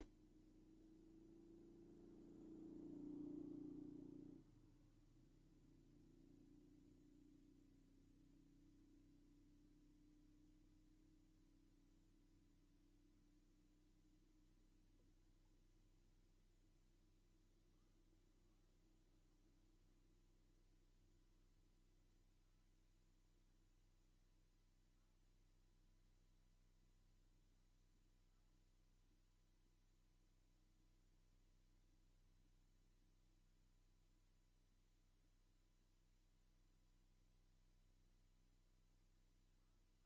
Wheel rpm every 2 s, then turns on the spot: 0, 0, 0, 0, 0, 0, 0, 0, 0, 0, 0, 0, 0, 0, 0, 0, 0, 0, 0, 0.
none